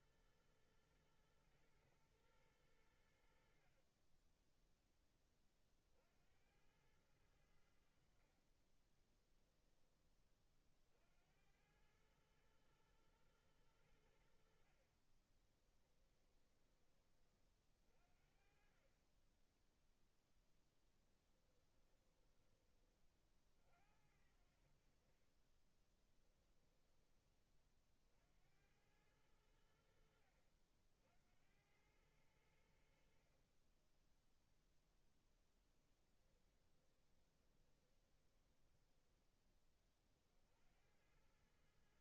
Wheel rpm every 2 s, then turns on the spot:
110, 100, 10, 80, 40, 40, 110, 60, 20, 50, 10, 30, 60, 20, 80, 60, 80, 0, 20, 10, 70.
4-6 8-10 16-18 20-22 26-28 36-40